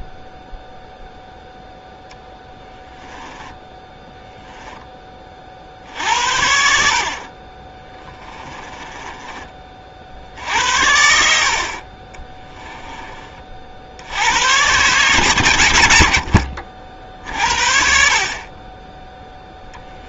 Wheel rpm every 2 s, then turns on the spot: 0, 10, 20, 60, 20, 60, 20, 120, 50, 10.
2-4 8-10